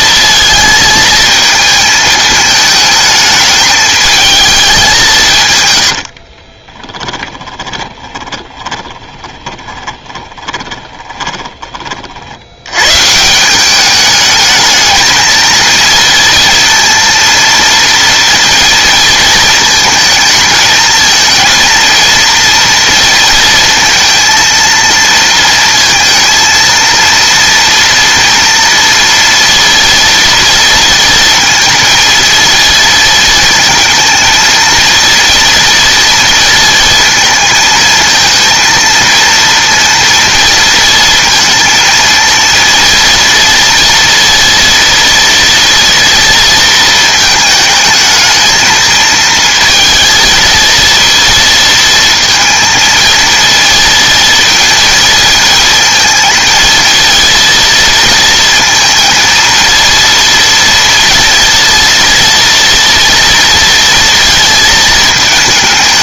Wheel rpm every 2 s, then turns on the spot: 220, 220, 210, 30, 20, 20, 100, 220, 230, 230, 220, 230, 230, 230, 230, 230, 230, 230, 230, 230, 230, 230, 230, 230, 220, 230, 230, 230, 230, 230, 230, 230, 220.
6-12